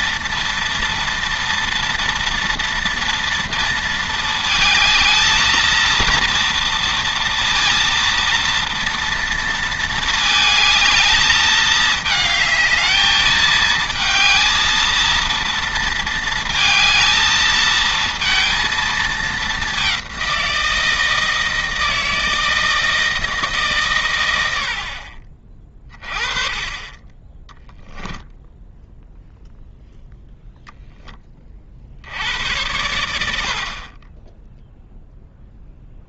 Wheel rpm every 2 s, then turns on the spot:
230, 230, 220, 230, 230, 220, 220, 230, 230, 220, 170, 160, 70, 30, 0, 0, 90, 0.
none